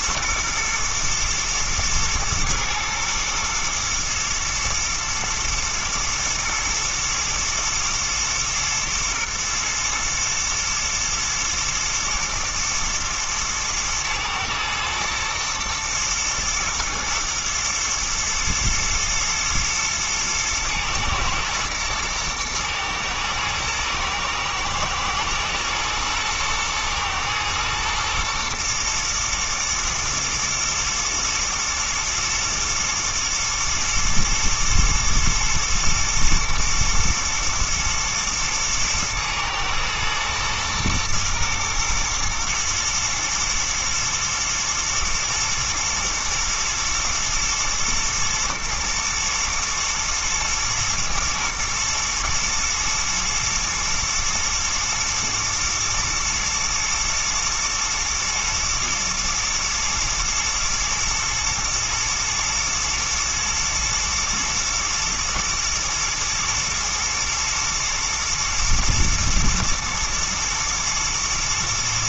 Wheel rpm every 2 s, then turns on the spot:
110, 120, 110, 110, 110, 110, 120, 110, 120, 120, 120, 110, 110, 110, 120, 120, 110, 120, 110, 110, 110, 120, 120, 120, 110, 110, 120, 120, 120, 120, 120, 110, 110, 110, 120, 110.
none